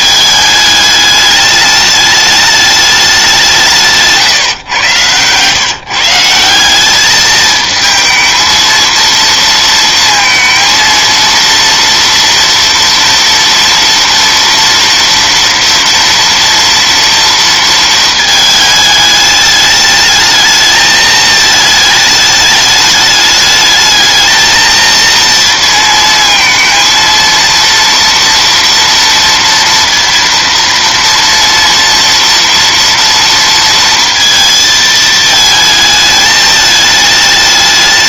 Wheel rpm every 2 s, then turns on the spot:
210, 210, 120, 190, 230, 230, 230, 230, 230, 220, 220, 210, 220, 230, 230, 230, 230, 220, 210.
none